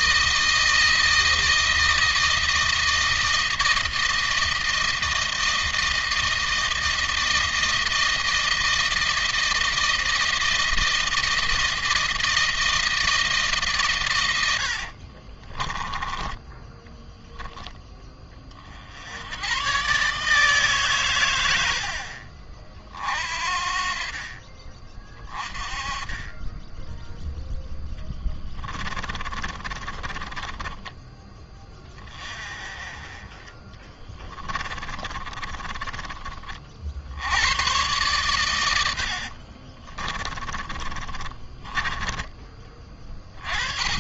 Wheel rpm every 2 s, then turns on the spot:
160, 160, 160, 160, 160, 160, 160, 70, 10, 60, 140, 50, 30, 10, 30, 20, 20, 20, 50, 80, 30, 20.
14-16 28-32 34-36 38-42